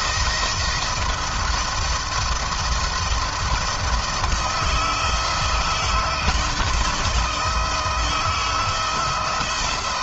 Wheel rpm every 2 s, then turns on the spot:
170, 170, 170, 160, 160.
none